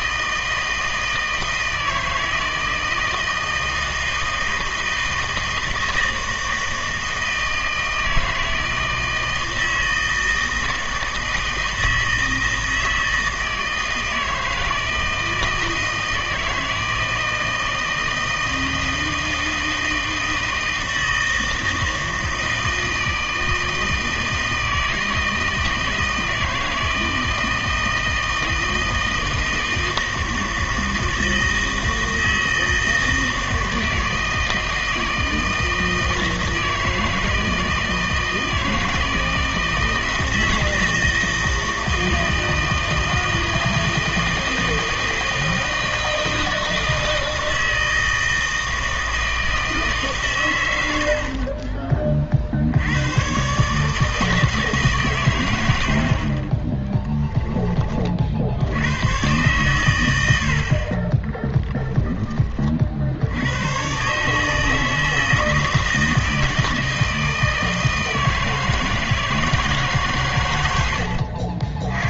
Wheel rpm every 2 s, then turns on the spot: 160, 160, 160, 160, 160, 160, 160, 160, 160, 160, 160, 160, 160, 160, 160, 160, 160, 160, 160, 160, 160, 160, 160, 160, 160, 100, 70, 150, 20, 70, 60, 30, 160, 160, 160, 110.
56-58